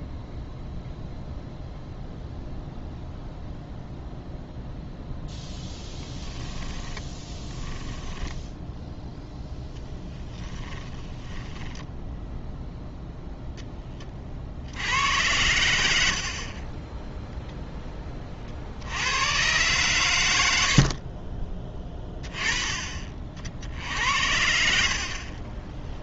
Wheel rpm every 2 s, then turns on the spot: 0, 0, 0, 10, 0, 10, 0, 90, 20, 50, 80, 30, 70.
6-8 10-12